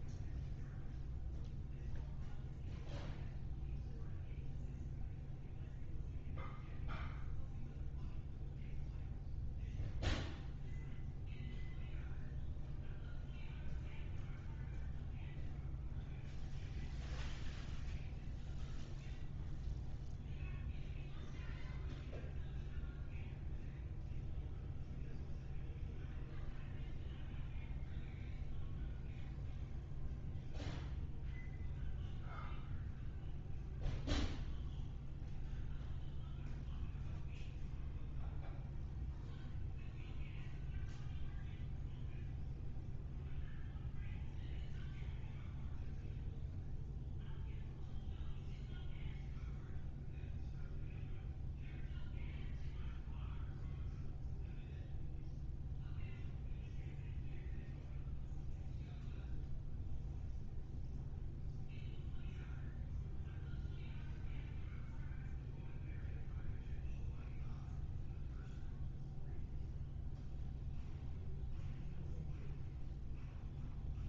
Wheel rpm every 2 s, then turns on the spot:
0, 0, 0, 0, 0, 0, 0, 0, 0, 0, 0, 0, 0, 0, 0, 0, 0, 0, 0, 0, 0, 0, 0, 0, 0, 0, 0, 0, 0, 0, 0, 0, 0, 0, 0, 0, 0.
none